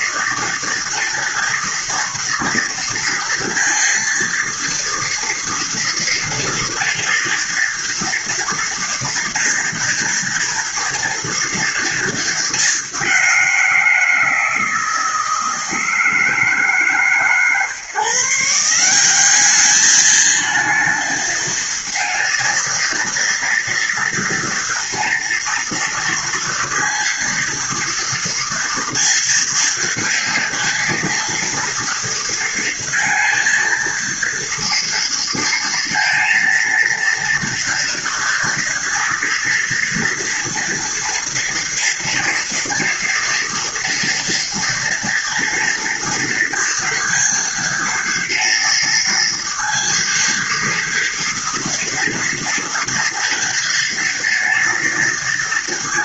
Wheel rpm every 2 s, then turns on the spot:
230, 230, 230, 230, 230, 230, 200, 160, 150, 190, 230, 230, 230, 230, 230, 230, 230, 230, 230, 230, 230, 230, 230, 230, 230, 230, 230, 230.
none